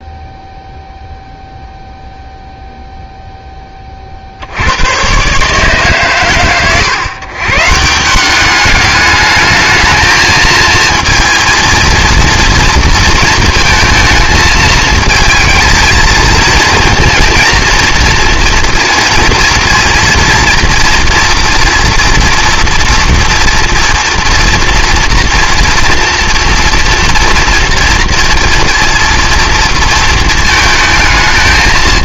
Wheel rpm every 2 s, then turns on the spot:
0, 0, 90, 130, 200, 230, 230, 220, 230, 230, 230, 230, 240, 230, 230, 220.
none